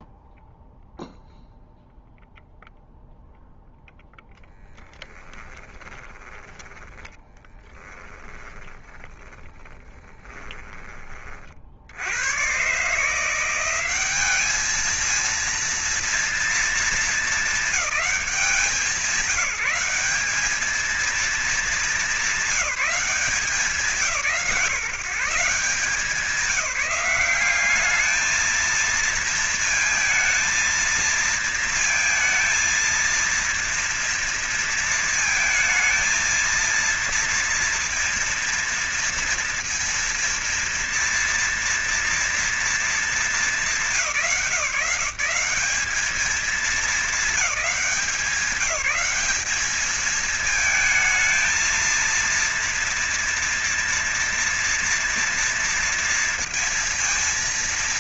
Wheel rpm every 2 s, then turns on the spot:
0, 0, 10, 10, 30, 20, 140, 210, 230, 200, 220, 190, 160, 200, 220, 230, 230, 230, 230, 230, 230, 220, 160, 200, 200, 220, 230, 240, 230.
4-10